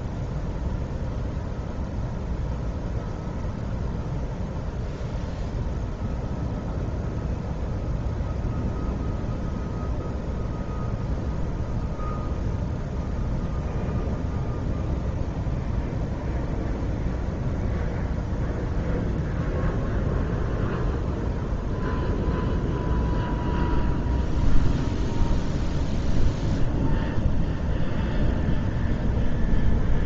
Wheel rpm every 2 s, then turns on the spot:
0, 0, 0, 0, 0, 0, 0, 0, 0, 0, 0, 0, 0, 0, 0.
none